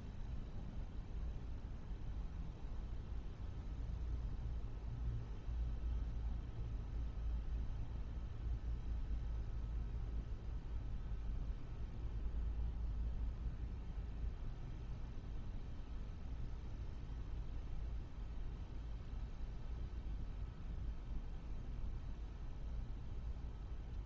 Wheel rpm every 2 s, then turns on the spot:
0, 0, 0, 0, 0, 0, 0, 0, 0, 0, 0, 0.
none